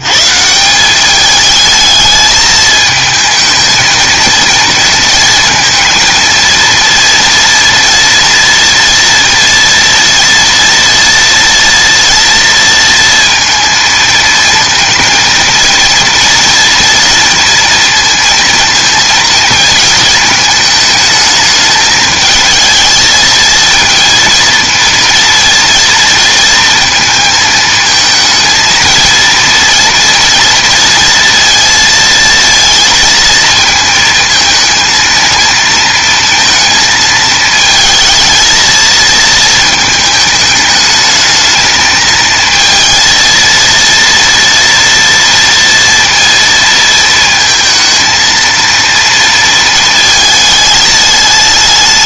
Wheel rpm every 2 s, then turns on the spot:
180, 220, 220, 230, 230, 240, 230, 230, 230, 230, 220, 220, 230, 220, 230, 230, 230, 230, 220, 220, 210, 230, 230, 230, 230, 220.
none